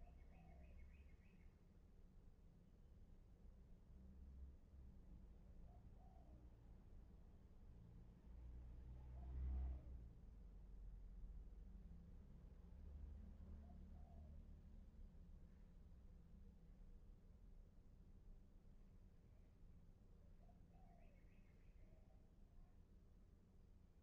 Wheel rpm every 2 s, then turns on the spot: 0, 0, 0, 0, 0, 0, 0, 0, 0, 0, 0, 0.
none